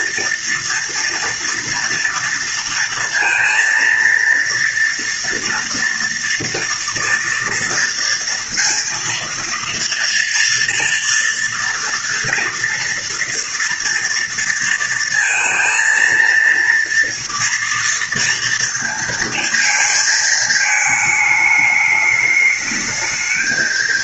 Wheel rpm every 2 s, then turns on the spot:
230, 230, 230, 230, 230, 230, 230, 230, 230, 230, 220, 210.
none